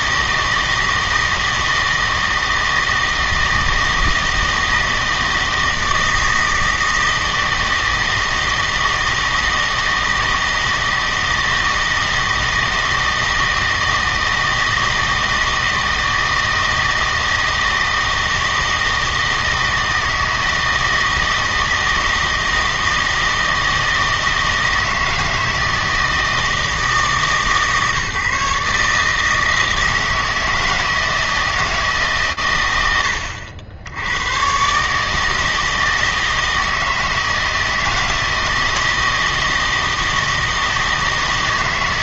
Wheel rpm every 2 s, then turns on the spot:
160, 160, 160, 160, 160, 160, 160, 160, 160, 160, 160, 160, 160, 160, 150, 160, 100, 140, 160, 160, 160.
none